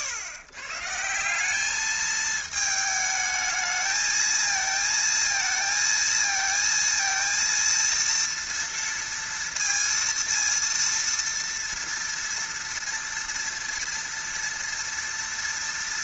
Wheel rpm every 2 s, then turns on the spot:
130, 220, 220, 220, 230, 230, 230, 230.
none